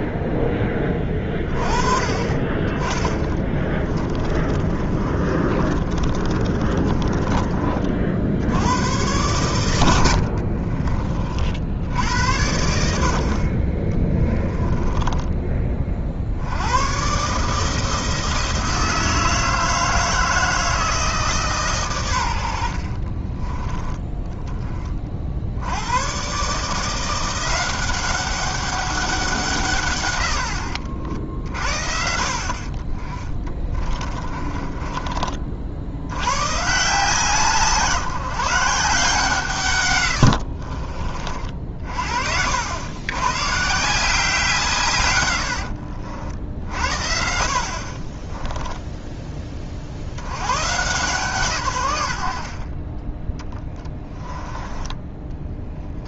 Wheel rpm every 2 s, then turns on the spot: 10, 20, 30, 30, 90, 40, 80, 10, 90, 160, 160, 70, 20, 150, 200, 80, 50, 30, 140, 160, 50, 80, 150, 60, 10, 130, 30, 20.
4-8 10-12 14-16 30-32 34-36 40-42 52-56